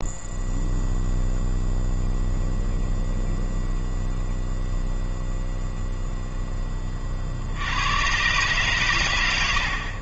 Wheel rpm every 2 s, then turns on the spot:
0, 0, 0, 30, 130.
none